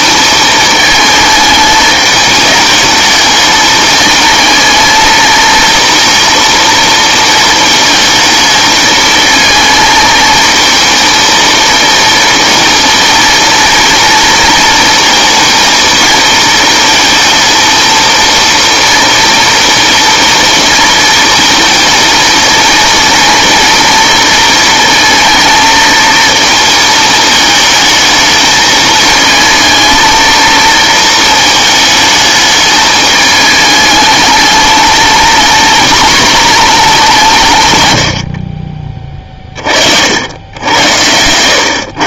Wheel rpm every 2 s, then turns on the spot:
220, 210, 230, 230, 220, 220, 230, 230, 230, 230, 220, 220, 230, 220, 220, 220, 210, 210, 220, 40, 90.
38-40